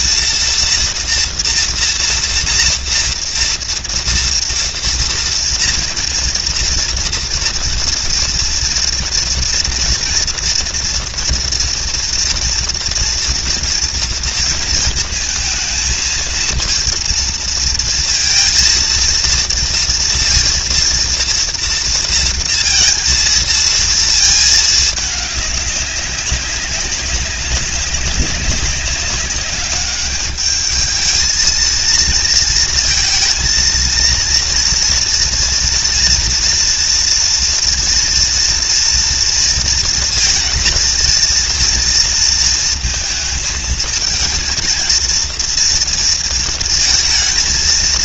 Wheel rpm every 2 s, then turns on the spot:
230, 230, 230, 230, 230, 240, 240, 230, 230, 230, 230, 230, 220, 200, 200, 220, 230, 230, 230, 230, 230, 220, 230, 230.
none